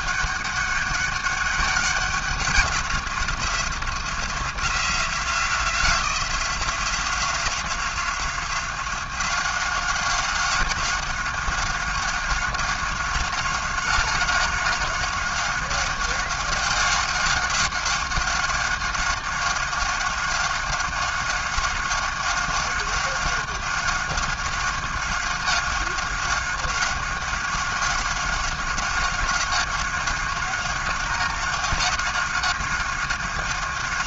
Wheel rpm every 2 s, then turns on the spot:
200, 190, 180, 180, 180, 190, 190, 190, 190, 190, 190, 190, 190, 190, 190, 190, 190.
none